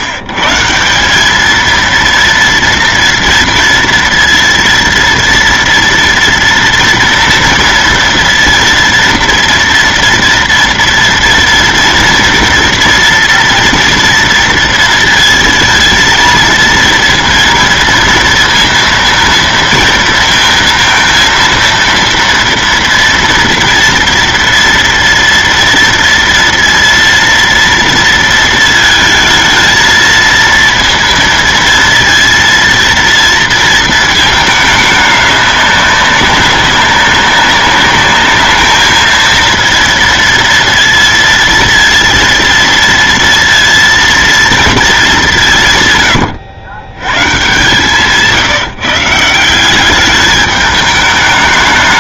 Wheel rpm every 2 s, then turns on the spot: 140, 230, 230, 230, 230, 230, 230, 230, 230, 230, 230, 230, 230, 230, 230, 230, 230, 220, 190, 210, 230, 230, 230, 90, 160, 210.
none